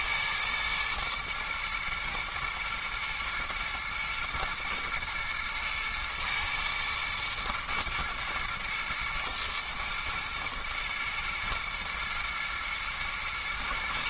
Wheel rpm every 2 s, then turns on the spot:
110, 110, 110, 110, 120, 110, 110.
none